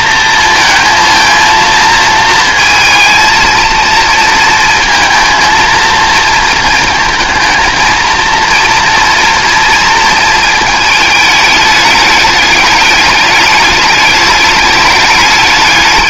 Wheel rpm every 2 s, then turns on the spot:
230, 230, 230, 230, 230, 220, 200, 210.
none